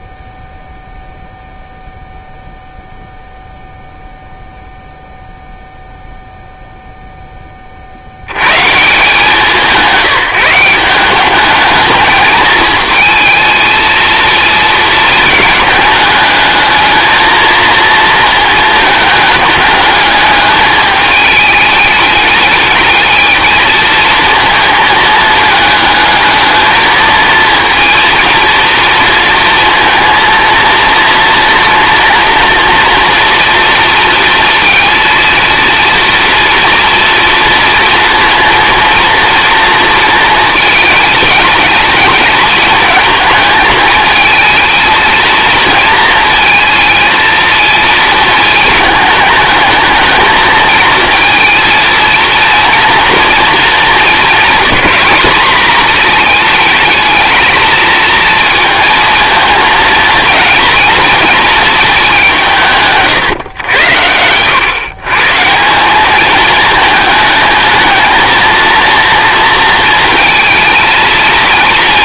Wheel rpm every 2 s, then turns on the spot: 0, 0, 0, 0, 140, 180, 220, 230, 220, 220, 210, 220, 220, 220, 230, 230, 230, 230, 230, 230, 220, 210, 220, 230, 220, 220, 230, 210, 220, 230, 230, 170, 120, 210, 230, 230.
none